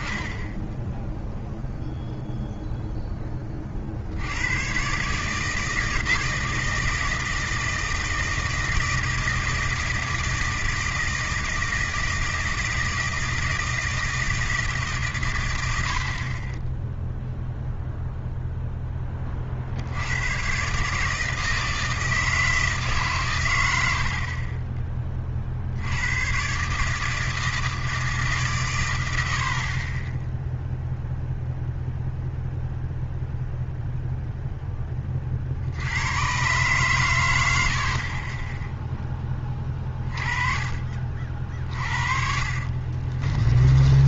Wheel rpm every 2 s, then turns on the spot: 10, 0, 100, 160, 160, 160, 160, 120, 0, 30, 160, 130, 40, 160, 70, 0, 0, 20, 120, 10, 40, 40.
42-44